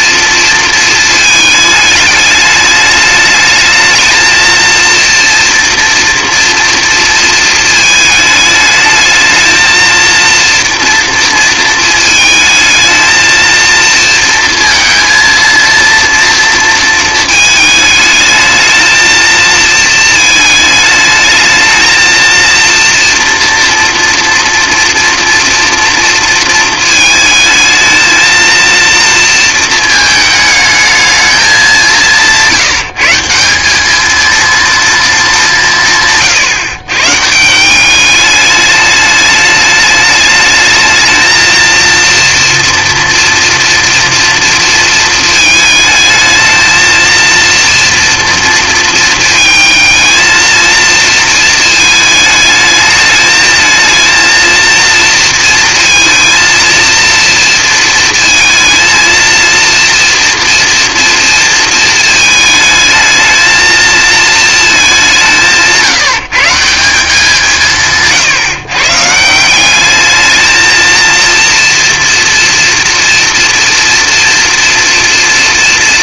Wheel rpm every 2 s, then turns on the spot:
220, 210, 230, 230, 210, 230, 220, 230, 220, 220, 220, 230, 230, 220, 230, 220, 160, 220, 130, 210, 220, 230, 230, 230, 230, 230, 210, 230, 230, 230, 230, 220, 200, 190, 130, 230, 230, 230.
none